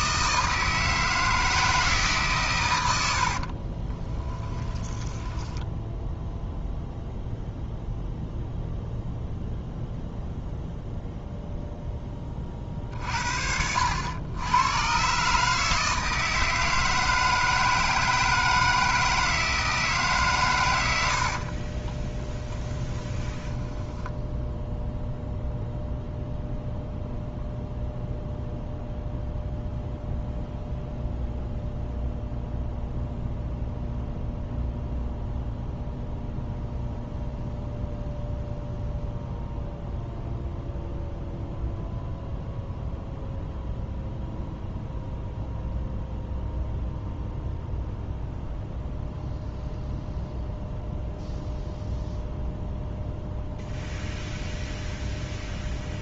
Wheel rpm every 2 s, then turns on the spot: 160, 100, 10, 0, 0, 0, 40, 120, 160, 160, 90, 20, 0, 0, 0, 0, 0, 0, 0, 0, 0, 0, 0, 0, 0, 0, 0, 0.
4-6 20-24